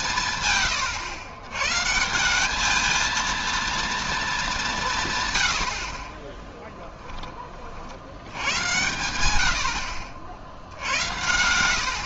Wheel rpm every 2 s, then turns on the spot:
120, 210, 170, 10, 100, 70.
none